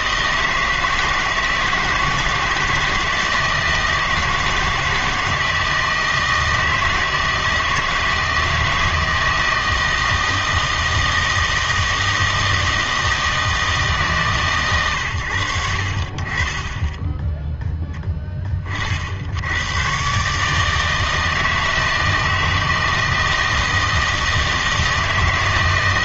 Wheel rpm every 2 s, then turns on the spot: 160, 160, 160, 160, 160, 160, 160, 120, 10, 40, 160, 160, 160.
none